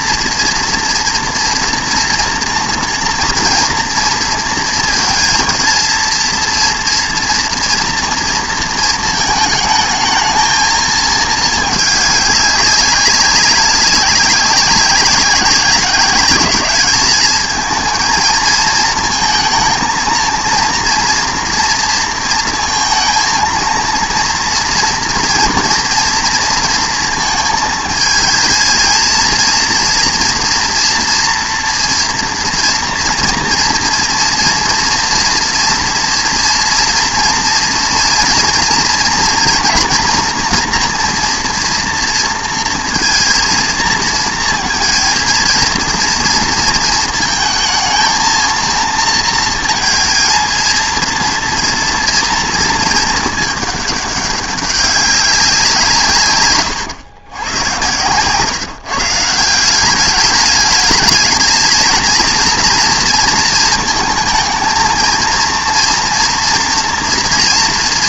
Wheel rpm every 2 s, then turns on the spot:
230, 230, 230, 230, 230, 220, 200, 200, 200, 230, 230, 230, 230, 230, 220, 230, 230, 230, 230, 230, 240, 230, 220, 230, 230, 230, 230, 200, 120, 150, 210, 230, 220, 240.
none